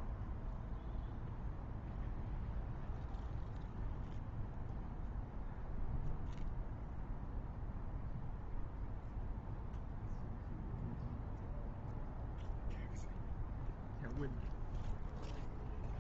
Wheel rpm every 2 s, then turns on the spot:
0, 0, 0, 0, 0, 0, 0, 0.
none